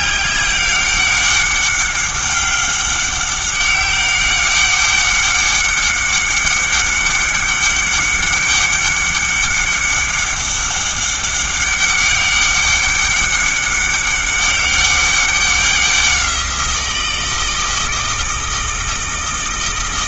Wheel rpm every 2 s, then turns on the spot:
200, 200, 200, 200, 200, 200, 200, 200, 170, 160.
none